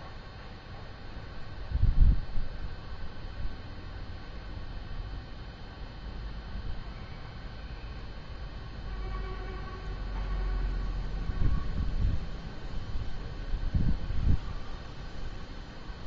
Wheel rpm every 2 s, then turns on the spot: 0, 0, 0, 0, 0, 0, 0, 0.
none